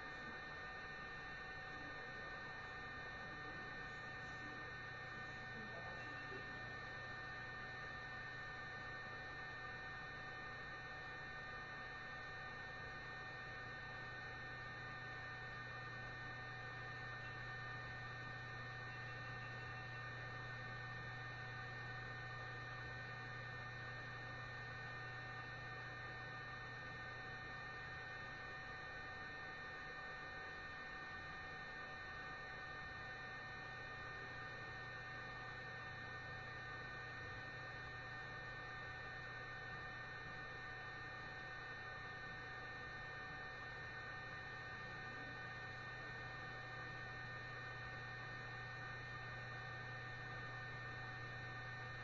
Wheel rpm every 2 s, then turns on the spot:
0, 0, 0, 0, 0, 0, 0, 0, 0, 0, 0, 0, 0, 0, 0, 0, 0, 0, 0, 0, 0, 0, 0, 0, 0, 0.
none